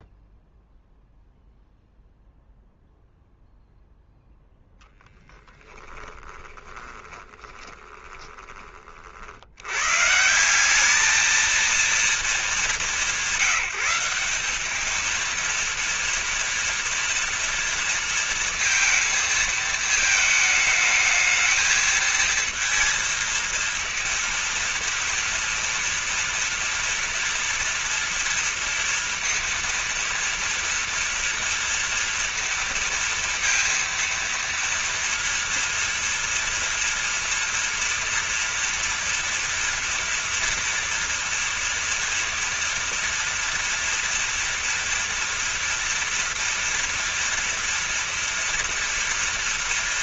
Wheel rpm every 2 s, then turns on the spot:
0, 0, 0, 20, 30, 190, 200, 210, 230, 230, 220, 230, 230, 230, 230, 230, 230, 230, 230, 230, 230, 230, 230, 230, 230.
6-8